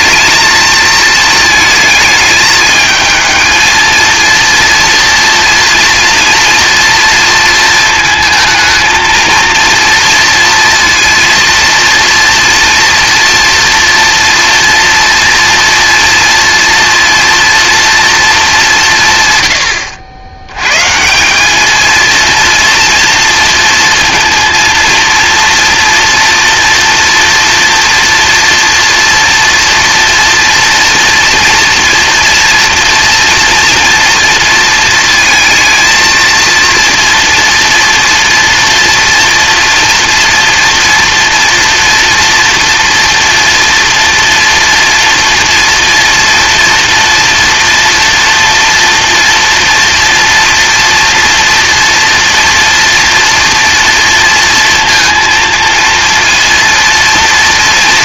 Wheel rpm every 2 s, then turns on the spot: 220, 220, 230, 230, 220, 230, 230, 230, 230, 200, 120, 230, 230, 230, 230, 230, 230, 230, 240, 230, 230, 240, 240, 230, 240, 230, 230, 220, 230.
none